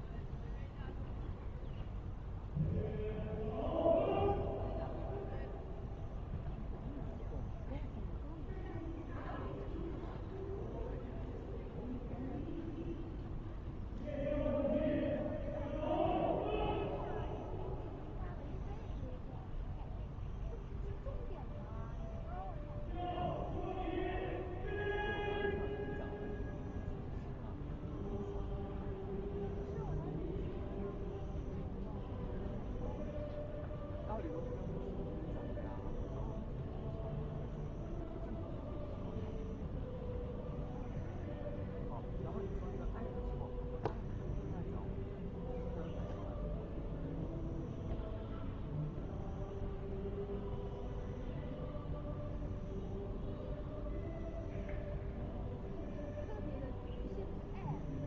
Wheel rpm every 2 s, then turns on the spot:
0, 0, 0, 0, 0, 0, 0, 0, 0, 0, 0, 0, 0, 0, 0, 0, 0, 0, 0, 0, 0, 0, 0, 0, 0, 0, 0, 0, 0.
none